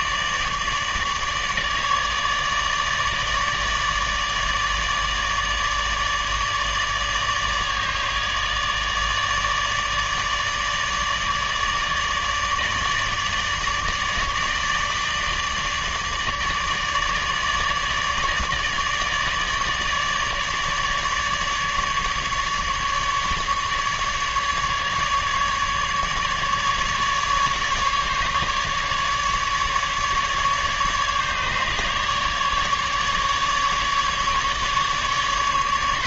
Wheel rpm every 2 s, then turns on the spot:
150, 150, 150, 150, 150, 150, 150, 150, 150, 150, 150, 150, 150, 150, 150, 150, 150, 150.
none